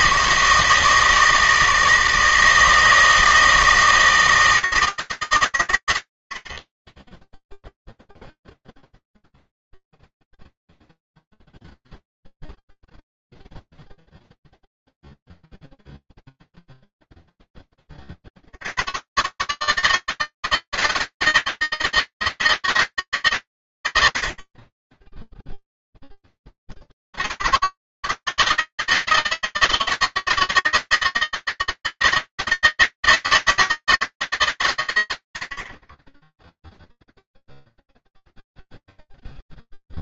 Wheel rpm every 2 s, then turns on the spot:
160, 160, 160, 40, 0, 0, 0, 0, 0, 70, 160, 160, 50, 20, 160, 160, 160, 140, 10, 0.
none